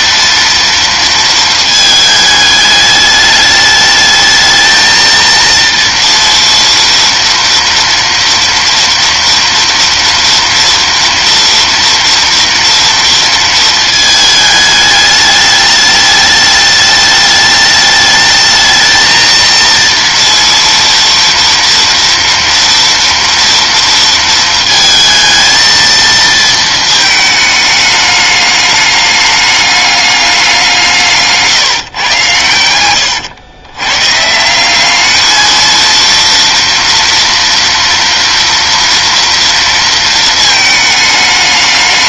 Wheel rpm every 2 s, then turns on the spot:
230, 210, 220, 230, 230, 230, 230, 210, 210, 220, 230, 230, 230, 220, 210, 180, 110, 180, 230, 230, 220.
none